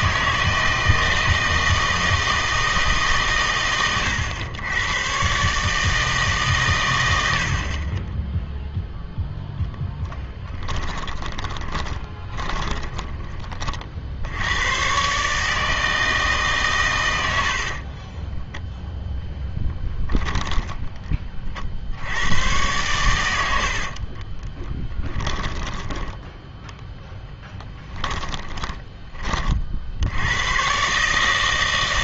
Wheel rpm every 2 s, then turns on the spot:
160, 160, 110, 140, 0, 10, 20, 110, 140, 10, 10, 100, 20, 10, 30, 110.
10-14 18-20 24-26 28-30